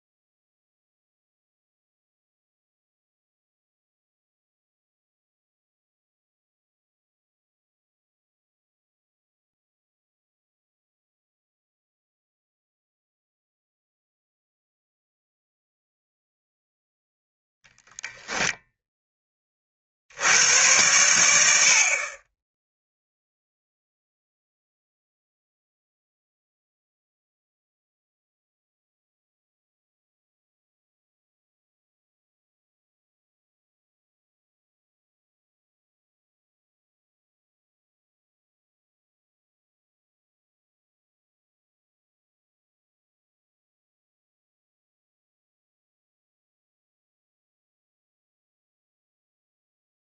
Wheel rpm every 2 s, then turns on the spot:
0, 0, 0, 0, 0, 0, 0, 0, 0, 0, 110, 0, 0, 0, 0, 0, 0, 0, 0, 0, 0, 0, 0, 0, 0.
none